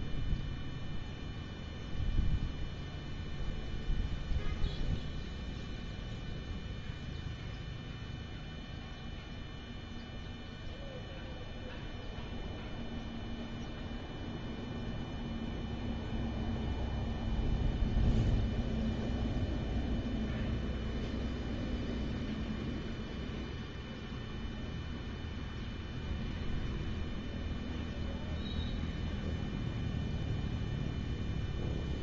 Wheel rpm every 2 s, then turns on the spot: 0, 0, 0, 0, 0, 0, 0, 0, 0, 0, 0, 0, 0, 0, 0, 0.
none